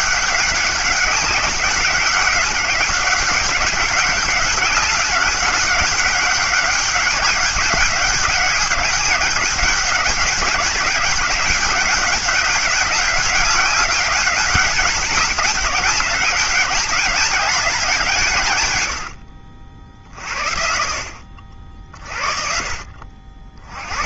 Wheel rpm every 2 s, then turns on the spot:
200, 190, 200, 200, 200, 200, 200, 200, 200, 110, 50, 50.
none